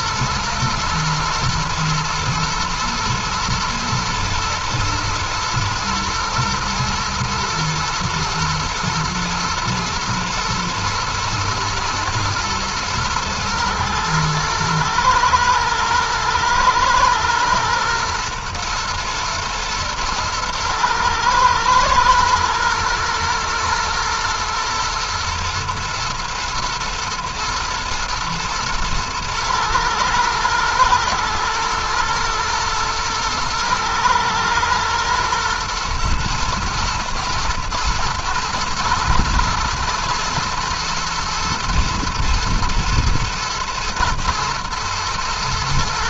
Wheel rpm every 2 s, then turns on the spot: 110, 120, 110, 110, 110, 120, 110, 110, 110, 120, 110, 110, 120, 110, 120, 110, 110, 120, 120, 110, 120, 120, 120.
none